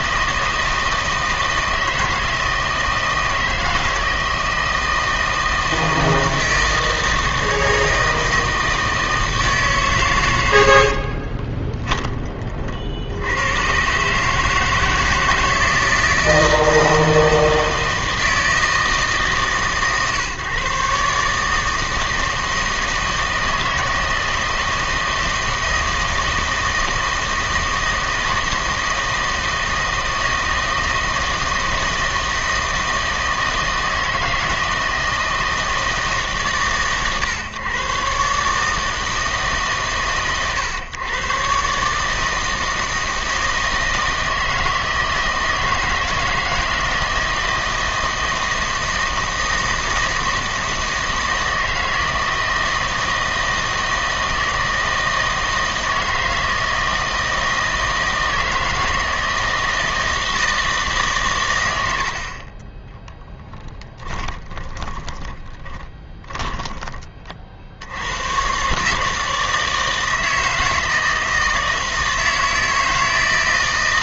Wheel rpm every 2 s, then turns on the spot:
160, 160, 160, 160, 160, 70, 60, 160, 160, 160, 140, 160, 160, 160, 160, 160, 160, 160, 130, 160, 120, 160, 160, 160, 160, 160, 160, 160, 160, 160, 150, 10, 30, 20, 140, 160, 160.
10-12 64-66